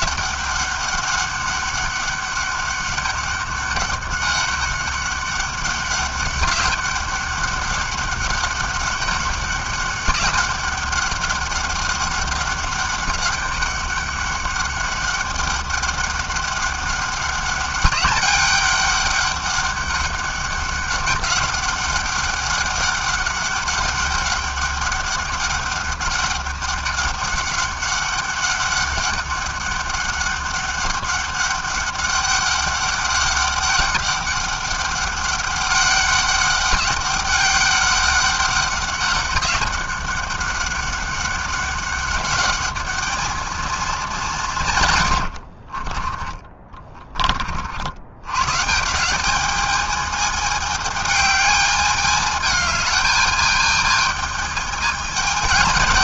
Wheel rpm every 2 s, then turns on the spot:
200, 200, 200, 200, 200, 200, 200, 200, 200, 200, 200, 200, 200, 190, 200, 200, 200, 200, 200, 200, 200, 220, 70, 40, 200, 210, 210, 210.
44-46